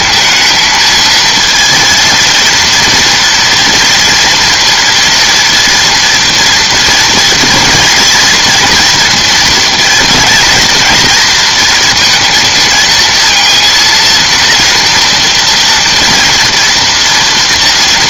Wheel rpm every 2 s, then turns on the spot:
220, 230, 240, 230, 230, 230, 230, 240, 230.
none